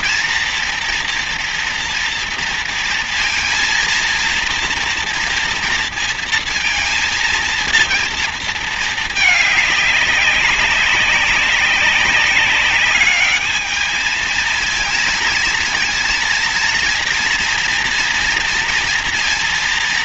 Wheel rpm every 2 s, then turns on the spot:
230, 230, 230, 230, 220, 200, 200, 220, 230, 230.
none